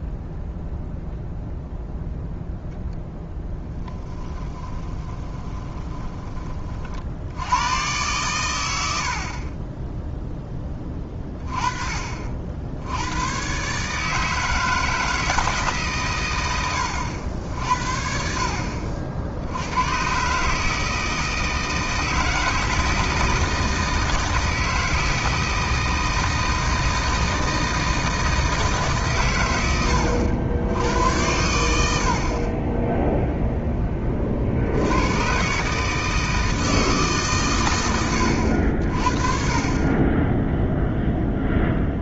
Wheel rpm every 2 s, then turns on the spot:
0, 0, 20, 40, 100, 20, 70, 160, 90, 50, 160, 160, 160, 160, 150, 90, 20, 80, 160, 70, 0.
4-6